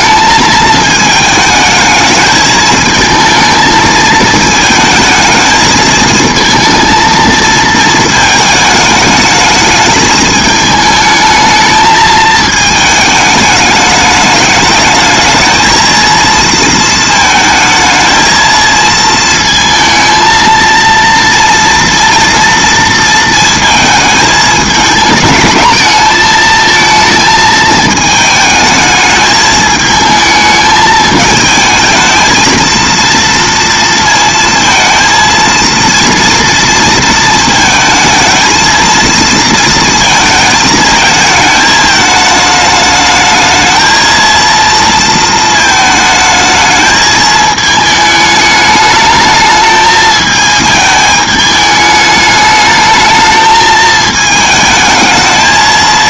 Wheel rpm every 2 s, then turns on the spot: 220, 220, 220, 230, 210, 220, 220, 210, 220, 220, 230, 230, 210, 220, 220, 220, 230, 230, 230, 230, 220, 210, 230, 220, 220, 220, 210, 220.
none